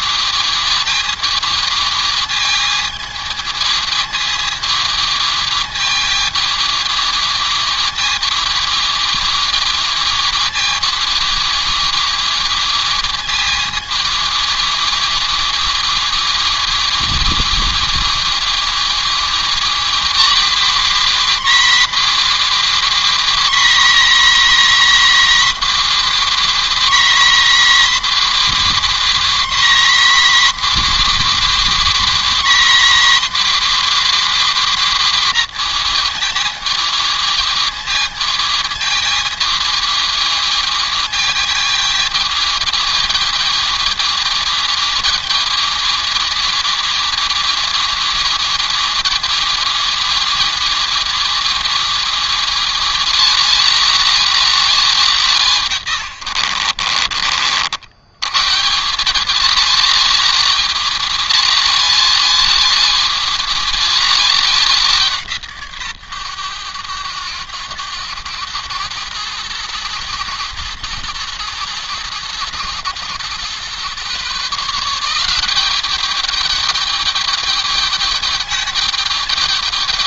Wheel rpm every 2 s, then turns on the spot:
220, 220, 220, 220, 220, 220, 220, 220, 220, 220, 260, 270, 270, 270, 270, 280, 270, 260, 220, 220, 220, 220, 220, 220, 220, 220, 220, 220, 80, 140, 230, 220, 200, 110, 100, 110, 110, 150, 210, 210.
56-58